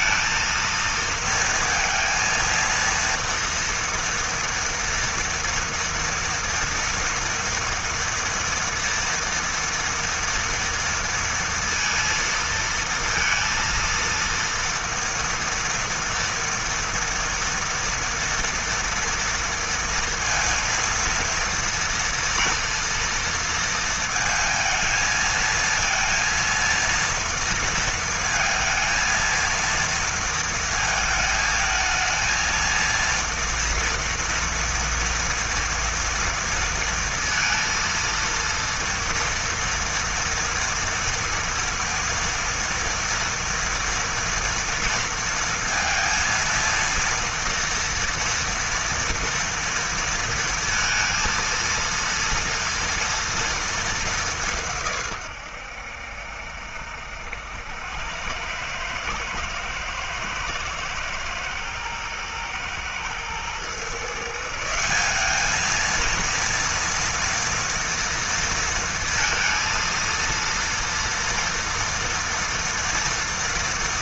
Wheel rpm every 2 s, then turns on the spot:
230, 230, 230, 230, 230, 230, 230, 230, 230, 230, 230, 230, 220, 230, 230, 220, 230, 240, 230, 230, 230, 230, 230, 230, 230, 230, 230, 130, 80, 110, 110, 120, 200, 230, 230, 230, 230.
none